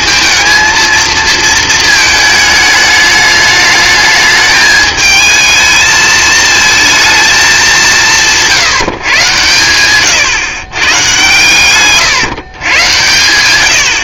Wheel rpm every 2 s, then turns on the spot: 220, 220, 210, 220, 160, 130, 120.
none